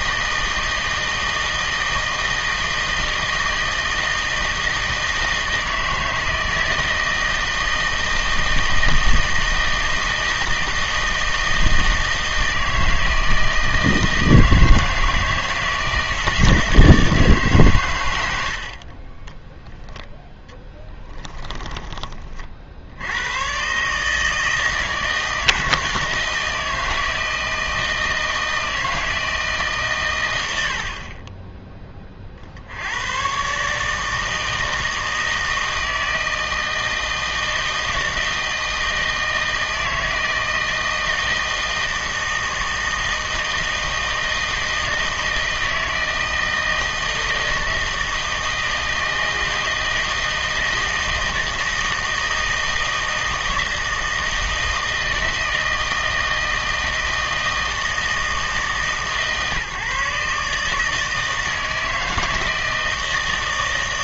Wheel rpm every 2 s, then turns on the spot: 160, 160, 160, 160, 160, 160, 160, 160, 160, 60, 10, 70, 160, 160, 160, 70, 70, 160, 160, 160, 160, 160, 160, 160, 160, 160, 160, 160, 160, 150, 150, 160.
20-22